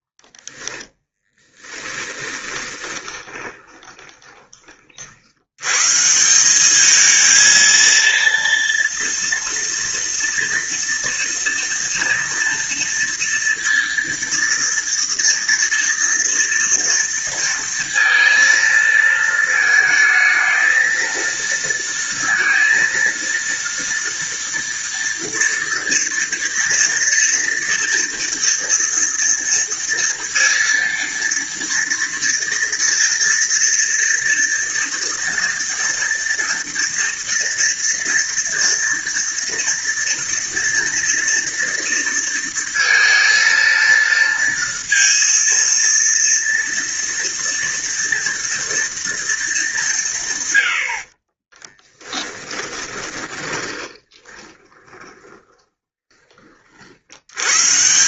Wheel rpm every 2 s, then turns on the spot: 10, 20, 30, 180, 230, 230, 240, 230, 230, 230, 220, 230, 230, 230, 230, 230, 230, 230, 230, 230, 230, 230, 230, 230, 230, 120, 20, 20, 30.
0-4 52-56